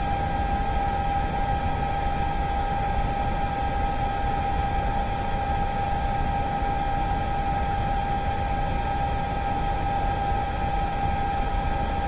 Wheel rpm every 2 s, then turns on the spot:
0, 0, 0, 0, 0, 0.
none